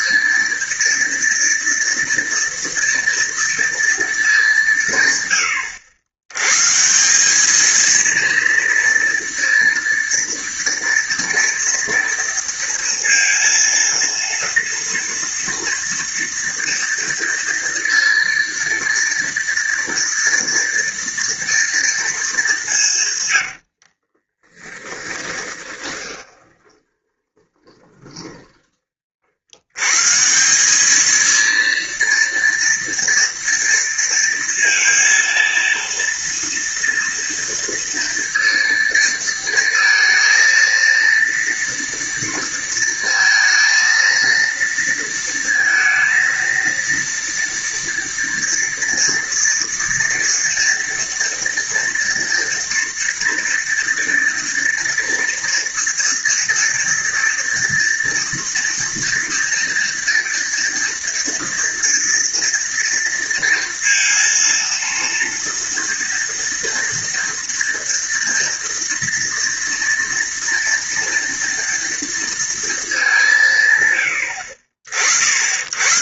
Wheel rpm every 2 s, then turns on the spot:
230, 230, 170, 140, 230, 230, 230, 230, 230, 230, 230, 190, 20, 20, 30, 190, 230, 230, 230, 230, 230, 230, 230, 230, 230, 230, 230, 230, 230, 240, 230, 230, 230, 230, 230, 230, 220, 70.
24-28